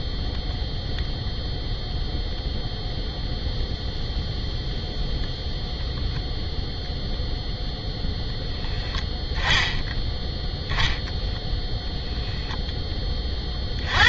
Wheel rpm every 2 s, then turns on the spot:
0, 0, 0, 0, 10, 0, 10.
none